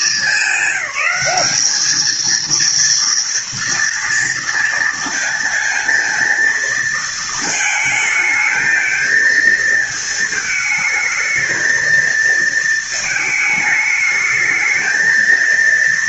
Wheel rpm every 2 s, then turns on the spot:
210, 230, 230, 230, 220, 220, 220, 220.
none